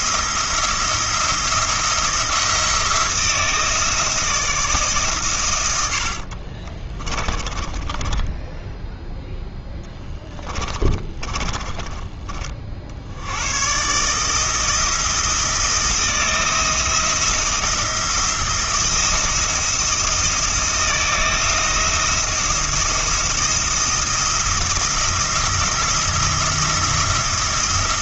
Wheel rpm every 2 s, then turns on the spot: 170, 170, 160, 40, 10, 20, 60, 160, 170, 170, 160, 170, 170, 170.
6-12